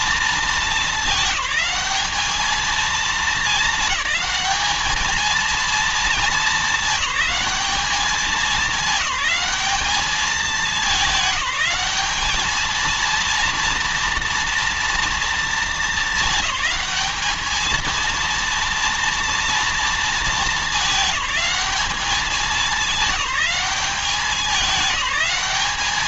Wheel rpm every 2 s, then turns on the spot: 210, 220, 220, 210, 210, 190, 230, 230, 220, 240, 210, 200, 210.
none